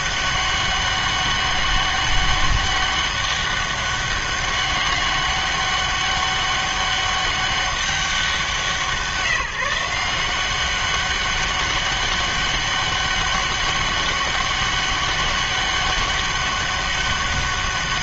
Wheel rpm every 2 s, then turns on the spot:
200, 200, 200, 200, 180, 190, 200, 200, 200.
none